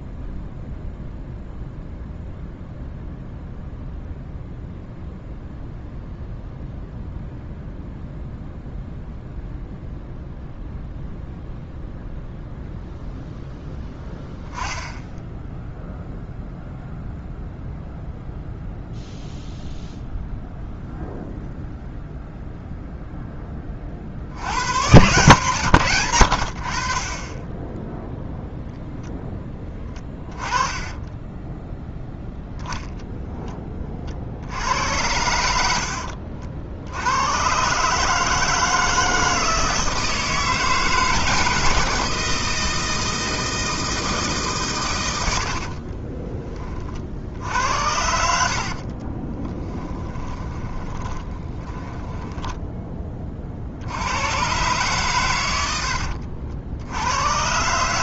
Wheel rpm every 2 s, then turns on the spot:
0, 0, 0, 0, 0, 0, 0, 10, 0, 0, 0, 0, 120, 50, 0, 20, 10, 90, 70, 160, 160, 160, 110, 40, 50, 20, 10, 130, 70.
48-52